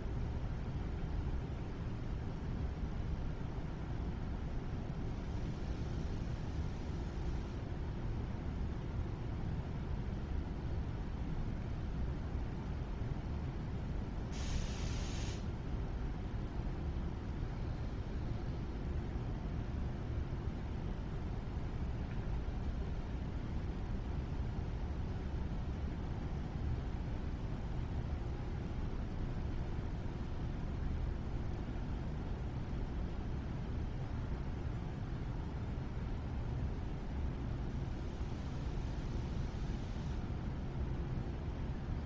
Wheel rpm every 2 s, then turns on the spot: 0, 0, 0, 0, 0, 0, 0, 0, 0, 0, 0, 0, 0, 0, 0, 0, 0, 0, 0, 0, 0.
none